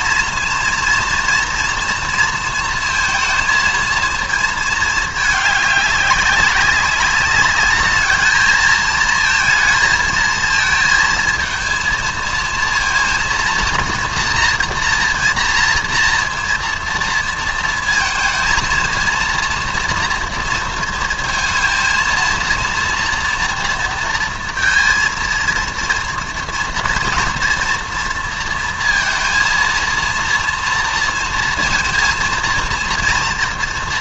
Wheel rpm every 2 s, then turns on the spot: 230, 230, 220, 200, 220, 220, 230, 230, 230, 220, 230, 240, 230, 230, 230, 230, 230.
none